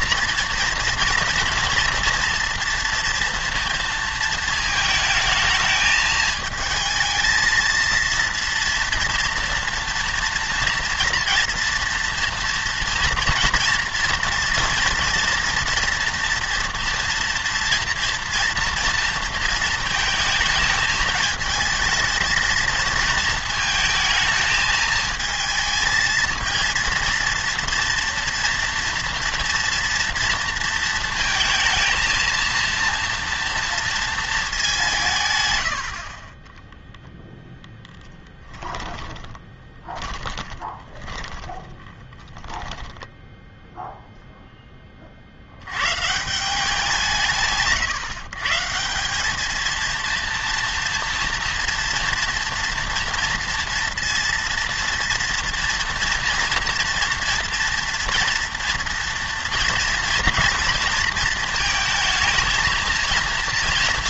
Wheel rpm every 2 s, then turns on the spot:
230, 230, 220, 220, 230, 240, 230, 230, 230, 230, 220, 230, 220, 230, 230, 230, 230, 200, 10, 10, 20, 10, 10, 170, 160, 230, 240, 230, 230, 230, 230, 230.
38-44